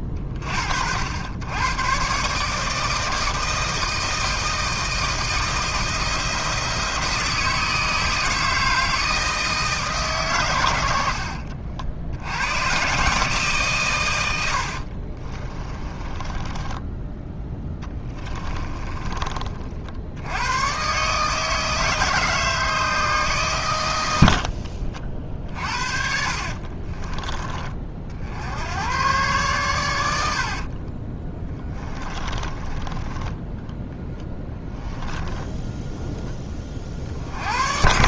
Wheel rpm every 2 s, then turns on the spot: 80, 160, 160, 160, 160, 80, 140, 40, 10, 30, 130, 150, 50, 40, 110, 30, 20, 20, 50.
10-12 14-20 24-28 30-34